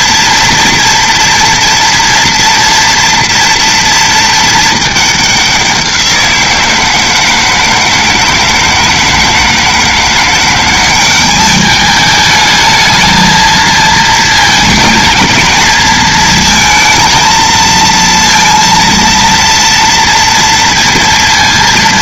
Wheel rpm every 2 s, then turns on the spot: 230, 230, 210, 170, 160, 190, 220, 220, 230, 230, 230.
none